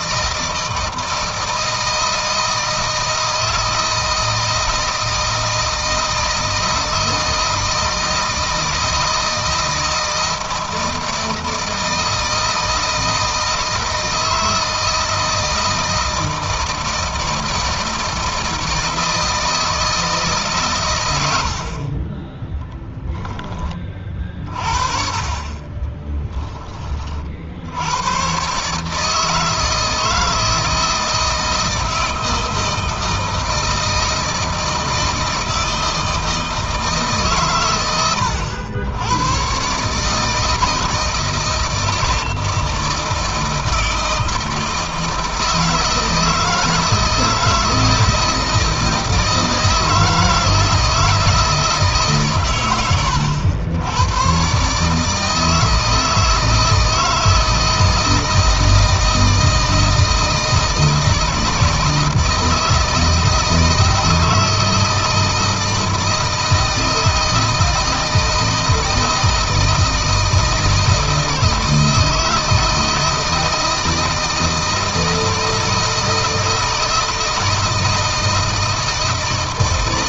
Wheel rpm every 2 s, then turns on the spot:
160, 160, 160, 160, 160, 160, 160, 160, 160, 160, 110, 10, 40, 30, 140, 160, 160, 160, 150, 100, 160, 160, 160, 160, 160, 160, 100, 150, 160, 160, 160, 160, 160, 160, 160, 160, 160, 160, 160, 160.
22-24